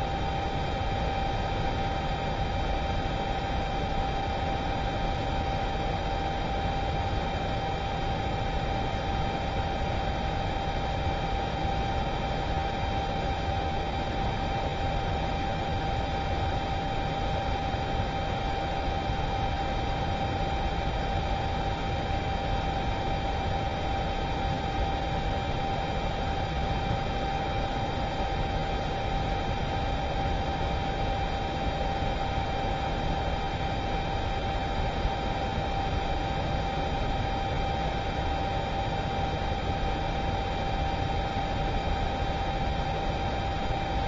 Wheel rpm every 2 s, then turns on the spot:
0, 0, 0, 0, 0, 0, 0, 0, 0, 0, 0, 0, 0, 0, 0, 0, 0, 0, 0, 0, 0, 0.
none